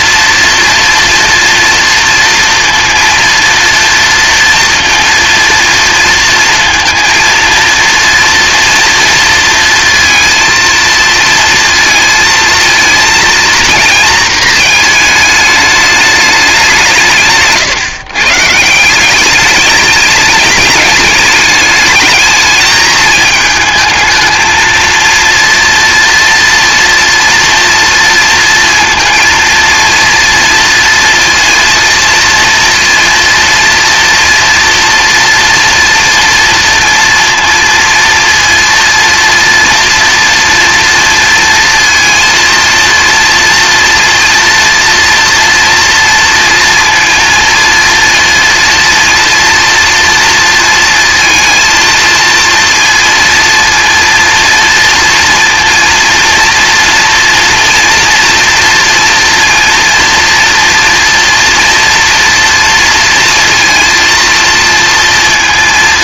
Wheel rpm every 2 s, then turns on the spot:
230, 230, 230, 230, 230, 230, 230, 220, 170, 190, 210, 220, 230, 240, 230, 230, 230, 230, 230, 230, 230, 230, 230, 230, 230, 230, 230, 230, 230, 230, 240, 230, 230.
none